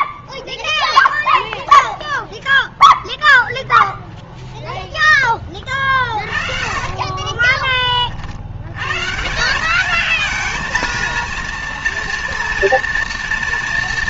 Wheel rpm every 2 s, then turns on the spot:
0, 0, 0, 40, 120, 230, 230.
6-8